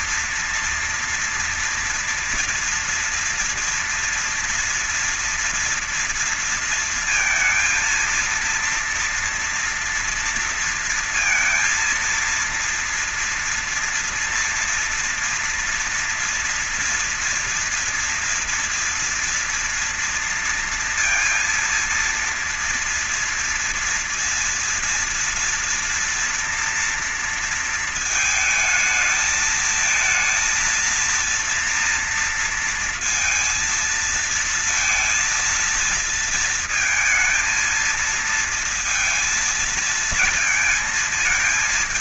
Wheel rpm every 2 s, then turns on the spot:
230, 230, 240, 230, 230, 230, 230, 240, 230, 240, 230, 230, 230, 230, 220, 230, 230, 230, 230, 230, 230.
none